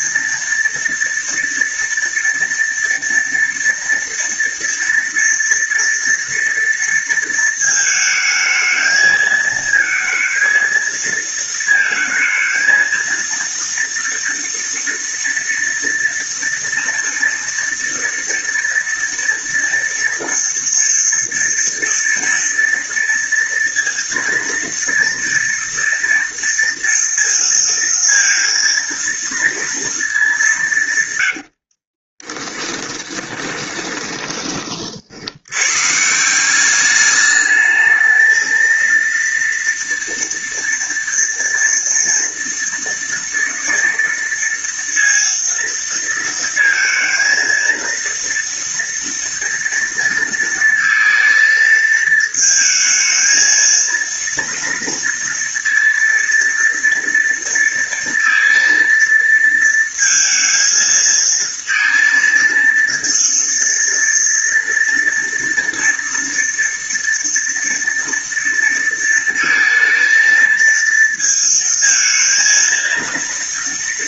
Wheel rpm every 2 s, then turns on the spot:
230, 230, 230, 230, 220, 230, 230, 230, 230, 230, 230, 230, 230, 230, 230, 190, 10, 20, 180, 220, 230, 230, 230, 230, 230, 230, 220, 230, 230, 230, 230, 230, 230, 230, 230, 230, 230.
32-34